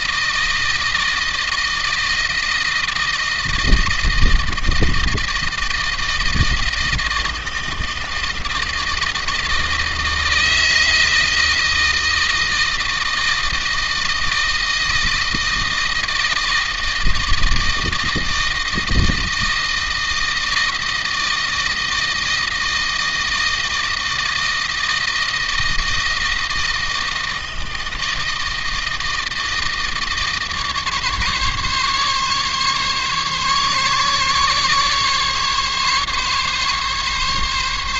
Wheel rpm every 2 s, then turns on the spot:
160, 160, 160, 160, 160, 160, 160, 160, 160, 160, 160, 160, 160, 160, 160, 150, 140, 140, 140.
none